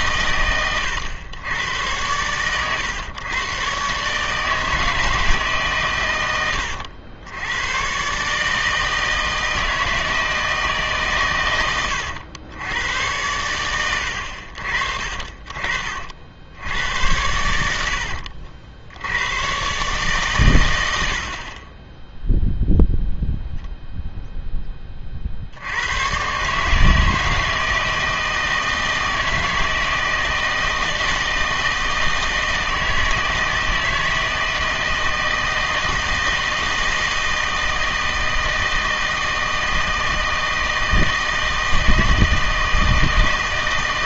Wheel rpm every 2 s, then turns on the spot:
100, 120, 160, 100, 160, 140, 90, 50, 90, 60, 110, 0, 20, 150, 160, 160, 160, 160, 160, 160, 160, 160.
none